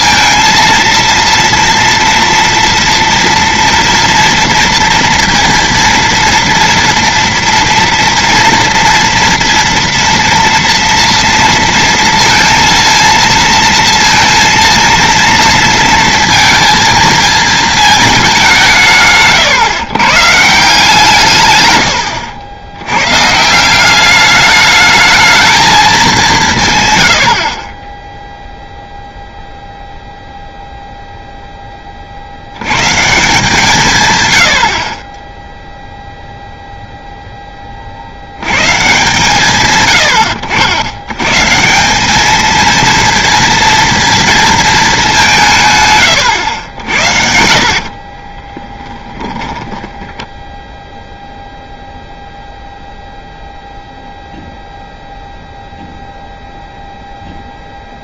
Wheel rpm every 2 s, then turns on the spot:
230, 230, 230, 230, 230, 230, 230, 230, 220, 170, 160, 90, 210, 140, 0, 0, 120, 60, 0, 120, 80, 230, 220, 90, 10, 0, 0, 0, 0.
48-50